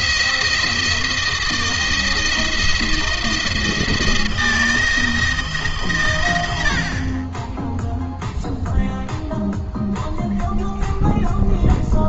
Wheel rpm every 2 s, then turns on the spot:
170, 170, 170, 70, 0, 0.
none